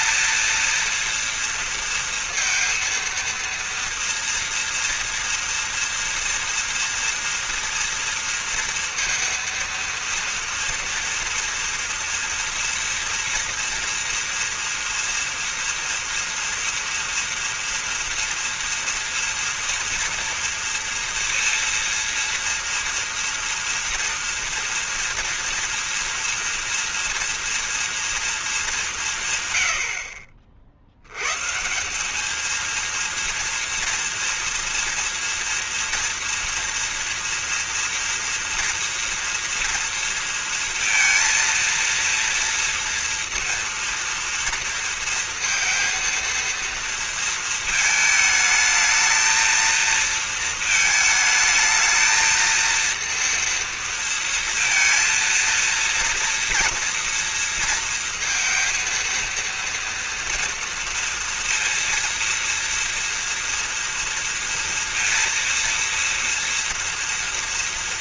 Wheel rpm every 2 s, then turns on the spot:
230, 230, 240, 230, 230, 230, 230, 230, 230, 230, 230, 230, 230, 230, 180, 80, 230, 230, 230, 230, 230, 230, 230, 230, 220, 230, 230, 230, 230, 230, 230, 230, 230, 230.
none